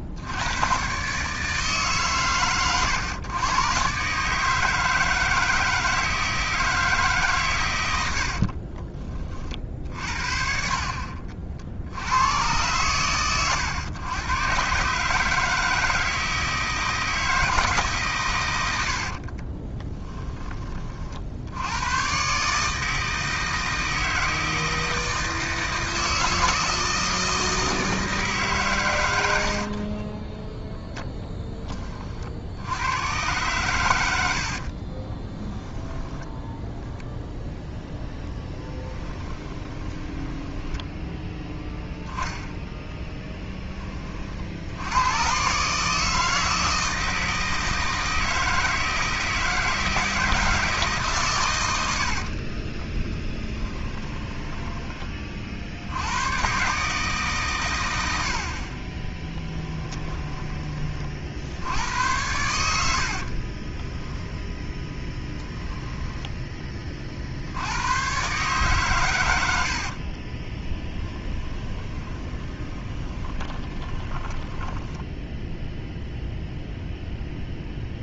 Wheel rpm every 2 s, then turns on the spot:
140, 120, 160, 150, 20, 50, 110, 140, 160, 60, 40, 160, 160, 160, 120, 0, 90, 50, 0, 10, 10, 10, 80, 160, 160, 150, 20, 10, 140, 20, 30, 70, 10, 40, 110, 10, 20, 10, 0.
18-20 34-36 38-40 52-54 58-60 62-66 70-76